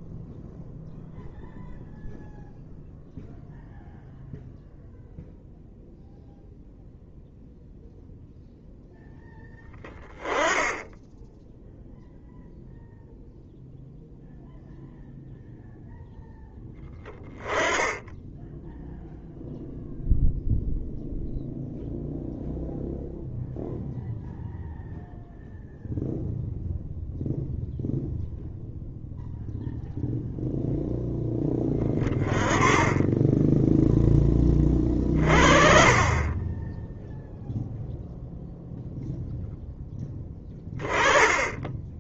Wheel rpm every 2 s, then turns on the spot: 0, 0, 0, 0, 0, 10, 0, 0, 10, 0, 0, 0, 0, 0, 0, 0, 10, 30, 10, 0, 20.
none